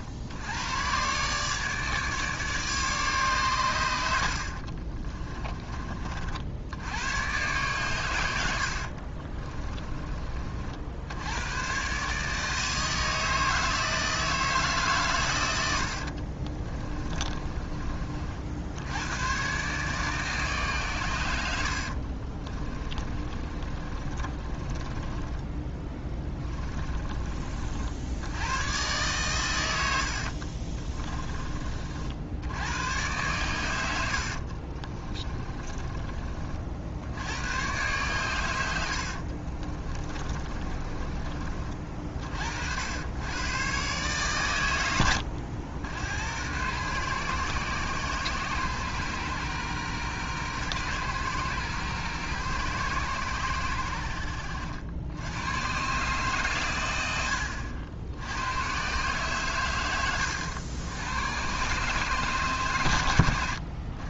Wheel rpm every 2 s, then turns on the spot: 100, 150, 40, 80, 70, 50, 160, 150, 30, 70, 140, 20, 30, 20, 110, 30, 100, 40, 60, 90, 30, 60, 110, 120, 120, 120, 120, 80, 110, 120, 100, 130.
4-6 16-18 22-28 30-32 34-36 40-42